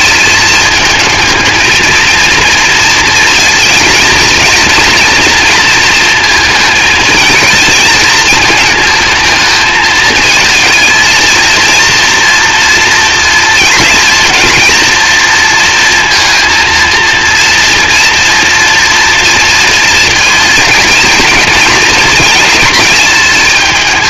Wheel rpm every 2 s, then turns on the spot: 220, 230, 230, 230, 220, 220, 230, 220, 230, 230, 220, 230.
none